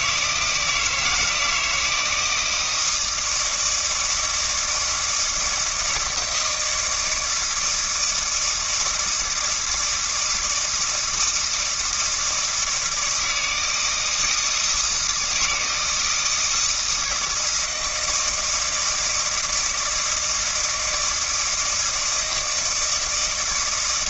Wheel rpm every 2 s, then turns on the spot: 160, 160, 160, 170, 160, 160, 160, 160, 160, 160, 160, 160.
none